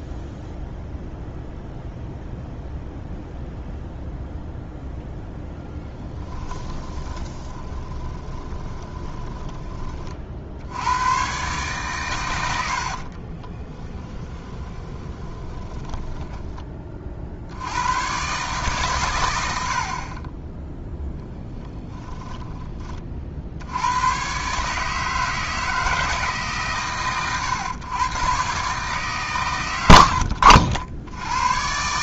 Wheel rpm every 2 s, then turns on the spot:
0, 0, 0, 10, 20, 80, 70, 20, 30, 130, 0, 20, 150, 130, 140, 70.
6-10 12-16